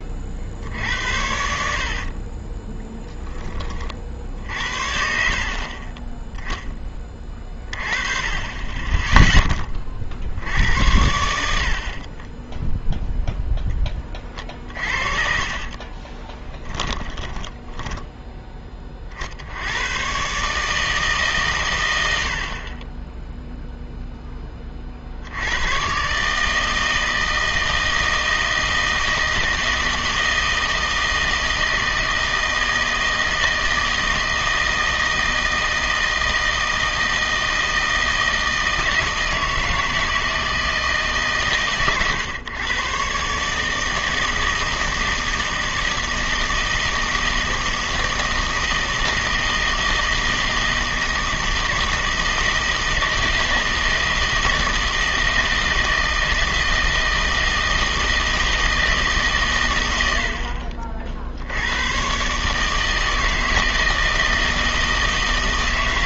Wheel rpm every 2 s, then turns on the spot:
70, 10, 60, 10, 20, 90, 0, 40, 20, 20, 150, 30, 30, 160, 160, 160, 160, 160, 160, 160, 160, 120, 160, 160, 160, 160, 160, 160, 160, 160, 50, 150, 160.
0-4 14-18